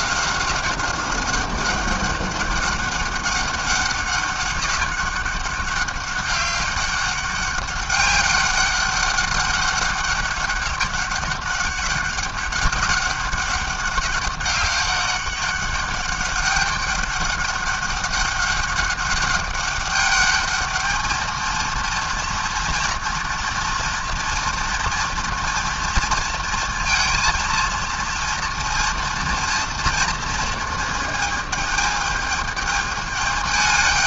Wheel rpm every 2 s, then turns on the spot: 190, 200, 200, 200, 200, 200, 200, 190, 200, 200, 220, 230, 240, 230, 230, 220, 210.
none